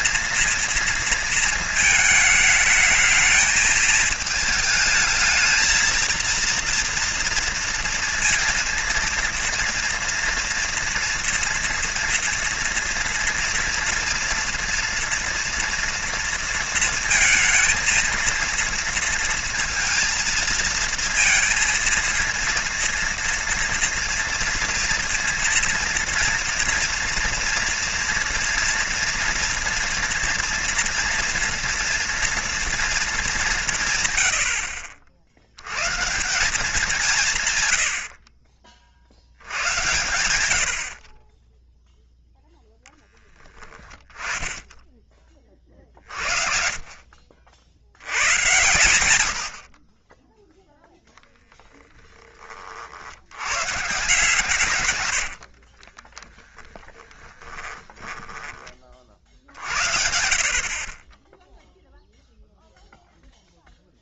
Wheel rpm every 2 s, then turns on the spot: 230, 220, 220, 230, 230, 230, 230, 240, 230, 230, 220, 230, 230, 230, 230, 230, 230, 70, 170, 50, 70, 0, 10, 50, 100, 10, 20, 140, 20, 10, 50, 0.
56-60